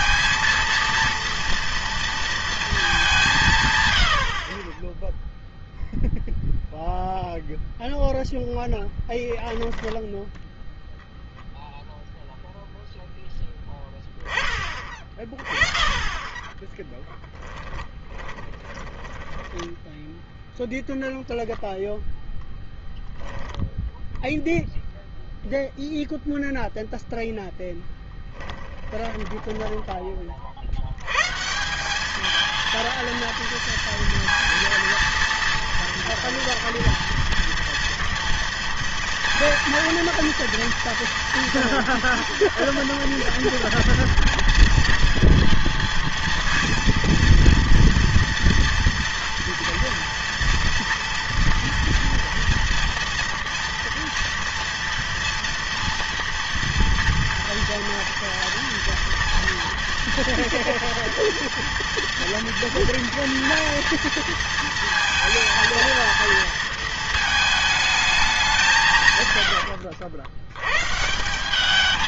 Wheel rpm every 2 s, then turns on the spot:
230, 220, 40, 0, 0, 0, 0, 20, 20, 20, 0, 0, 0, 0, 20, 70, 230, 230, 230, 230, 230, 230, 230, 230, 230, 230, 230, 230, 230, 230, 230, 230, 230, 230, 170, 120.
16-20 28-30